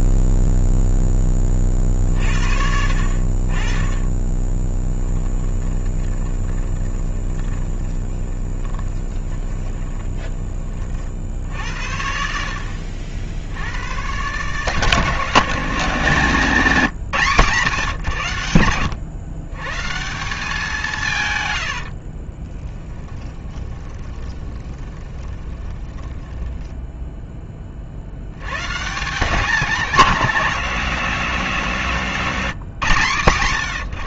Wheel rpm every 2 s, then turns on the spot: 0, 60, 20, 20, 20, 30, 70, 150, 170, 100, 150, 10, 20, 10, 150, 180, 140.
4-10 22-26